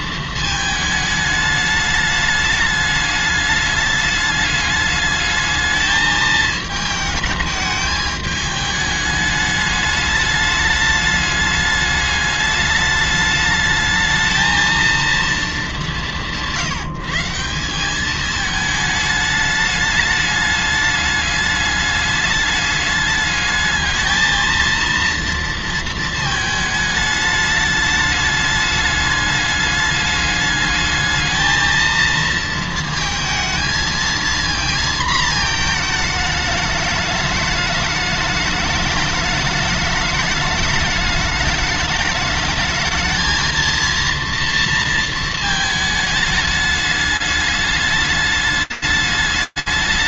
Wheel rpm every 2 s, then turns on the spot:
220, 210, 210, 210, 210, 210, 210, 220, 170, 210, 210, 210, 230, 210, 210, 220, 230, 230, 210, 210, 210, 220, 230, 210, 210.
none